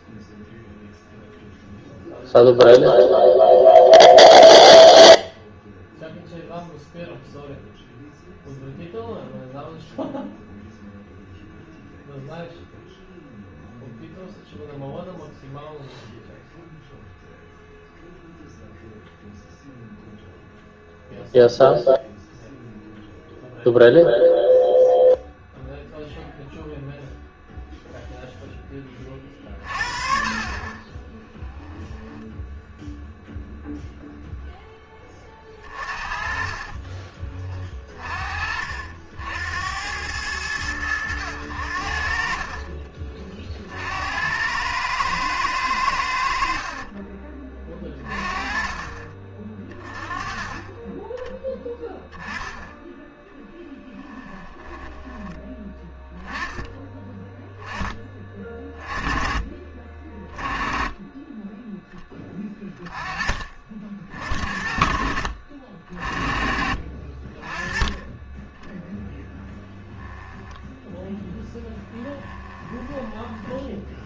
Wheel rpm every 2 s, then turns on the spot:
0, 0, 0, 0, 0, 0, 0, 0, 0, 0, 0, 0, 0, 0, 10, 30, 0, 0, 30, 50, 90, 30, 100, 50, 30, 20, 10, 20, 10, 20, 20, 30, 50, 40, 10, 0, 10.
36-38 42-44 46-48 54-56 72-74